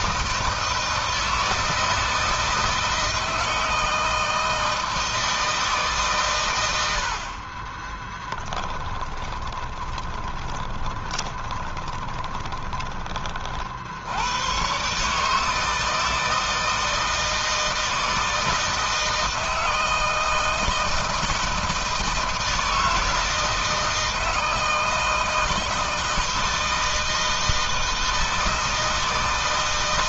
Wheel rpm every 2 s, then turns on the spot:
160, 160, 160, 110, 10, 20, 20, 120, 160, 160, 160, 160, 160, 160, 160.
8-14